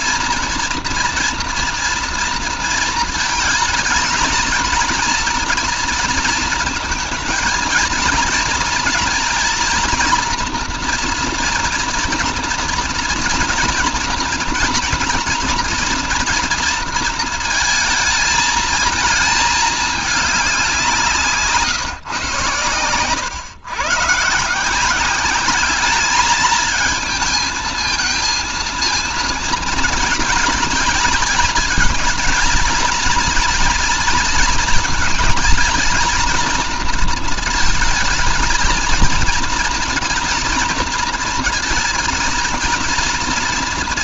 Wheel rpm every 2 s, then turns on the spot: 240, 230, 230, 230, 240, 240, 230, 230, 230, 230, 180, 120, 180, 220, 230, 230, 230, 230, 230, 230, 230, 230.
none